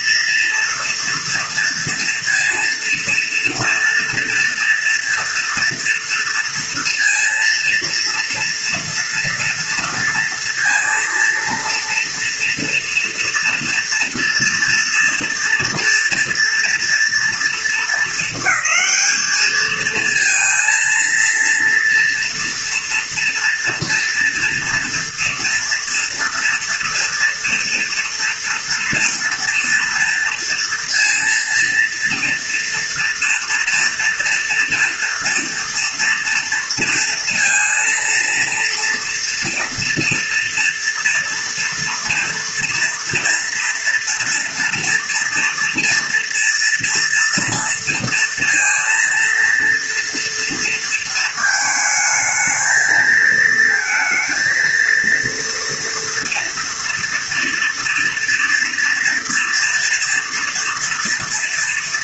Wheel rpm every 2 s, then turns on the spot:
230, 230, 230, 230, 230, 230, 240, 240, 230, 220, 230, 230, 230, 240, 230, 230, 230, 230, 230, 230, 230, 230, 230, 230, 230, 230, 220, 230, 230, 230, 230.
none